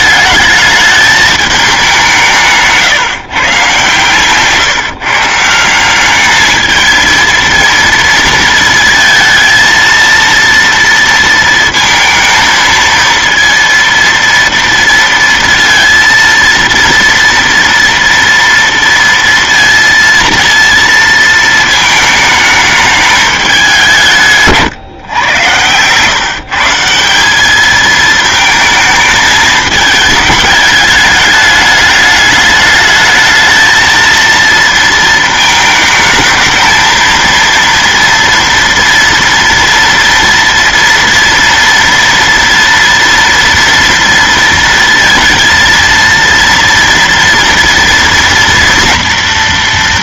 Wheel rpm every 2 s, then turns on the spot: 210, 160, 150, 220, 230, 230, 230, 230, 230, 230, 230, 220, 150, 150, 220, 210, 210, 230, 220, 230, 230, 230, 230, 230, 240.
24-26